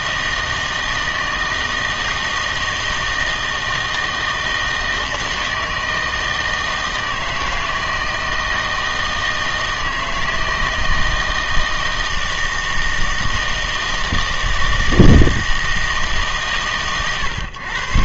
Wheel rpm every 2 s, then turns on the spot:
160, 160, 160, 160, 160, 160, 160, 160, 130.
none